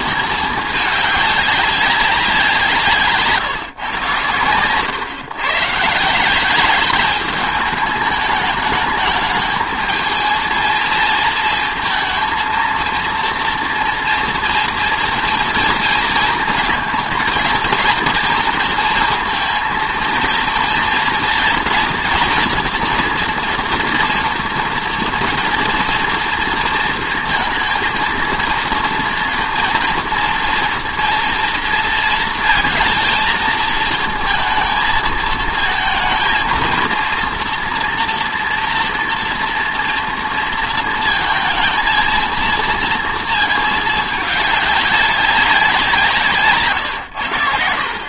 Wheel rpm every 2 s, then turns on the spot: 210, 170, 110, 200, 210, 230, 230, 230, 220, 230, 230, 240, 240, 230, 230, 230, 230, 230, 230, 230, 230, 230, 200, 140.
none